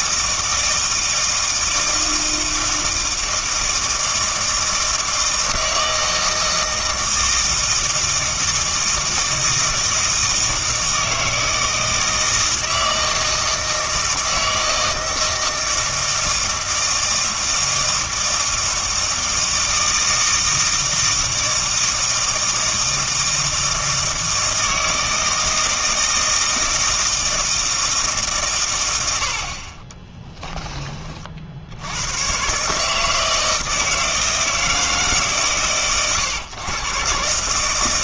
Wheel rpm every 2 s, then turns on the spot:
160, 160, 160, 160, 160, 160, 160, 160, 160, 160, 160, 160, 160, 160, 130, 10, 130, 160, 120.
none